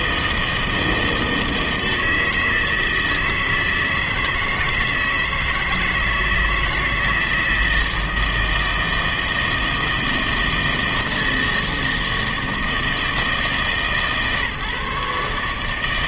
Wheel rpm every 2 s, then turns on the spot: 160, 160, 160, 160, 160, 160, 160, 150.
none